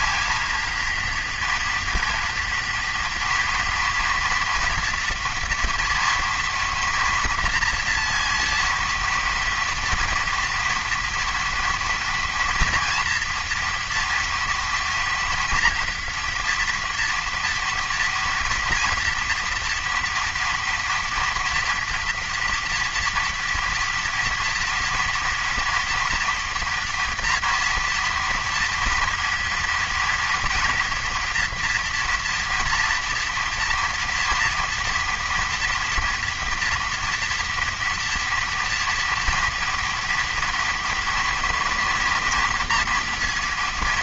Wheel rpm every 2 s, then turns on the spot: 230, 230, 230, 230, 230, 230, 240, 230, 230, 240, 230, 230, 230, 230, 230, 230, 230, 230, 230, 230, 240, 230.
none